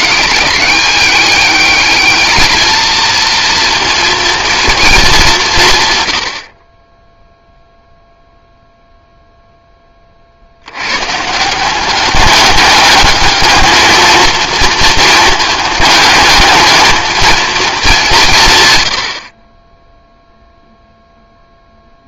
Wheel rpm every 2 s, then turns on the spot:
200, 220, 230, 10, 0, 110, 210, 220, 220, 100, 0.
none